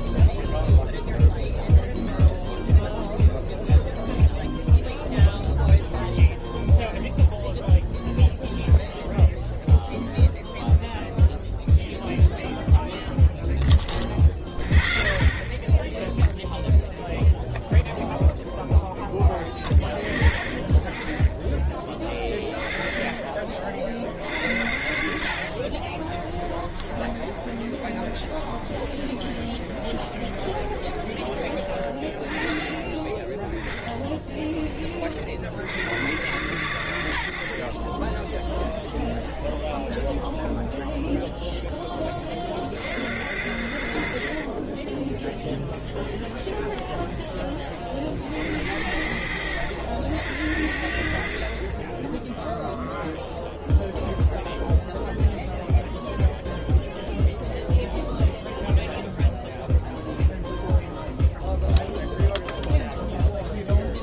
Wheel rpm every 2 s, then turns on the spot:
0, 0, 0, 0, 0, 0, 0, 0, 0, 0, 10, 20, 70, 30, 30, 30, 20, 20, 110, 30, 10, 40, 40, 20, 60, 70, 0, 0, 0, 0, 0, 0.
26-32 38-42 44-48